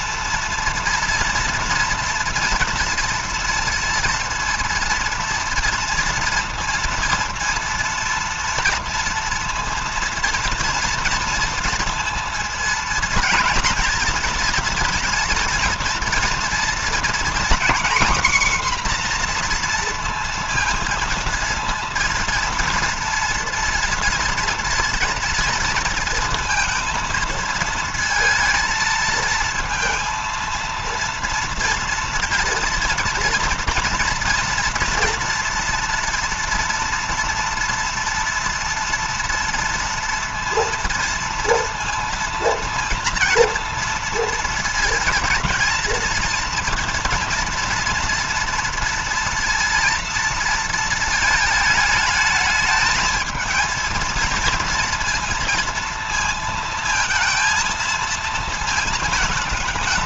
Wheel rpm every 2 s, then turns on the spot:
230, 230, 230, 230, 230, 230, 230, 230, 230, 260, 230, 230, 230, 230, 230, 230, 230, 240, 230, 230, 230, 230, 230, 230, 230, 230, 220, 220, 230, 230.
none